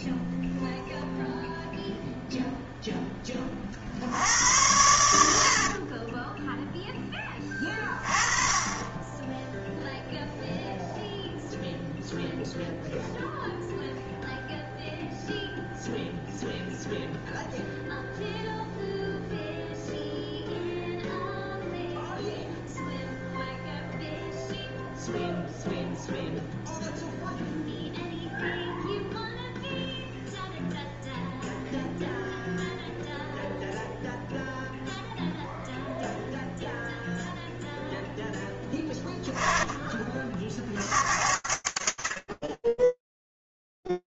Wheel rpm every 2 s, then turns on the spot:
10, 30, 70, 10, 10, 0, 0, 0, 0, 0, 0, 0, 0, 0, 0, 0, 0, 0, 0, 10, 90, 20.
4-6